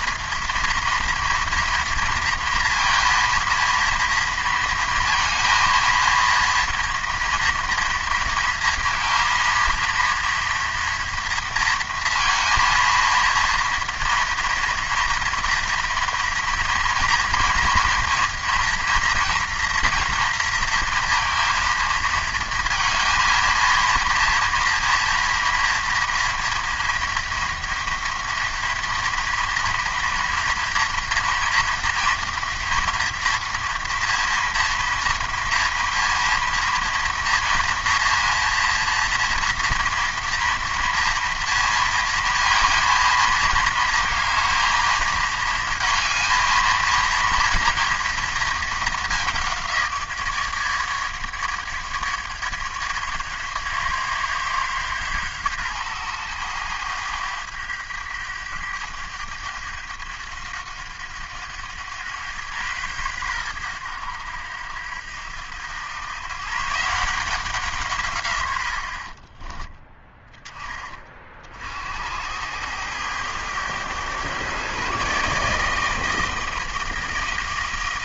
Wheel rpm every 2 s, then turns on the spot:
230, 230, 230, 230, 230, 230, 230, 230, 230, 240, 230, 230, 230, 230, 230, 230, 230, 230, 230, 240, 230, 230, 220, 230, 220, 150, 150, 140, 100, 100, 90, 110, 80, 150, 70, 20, 100, 130, 160.
none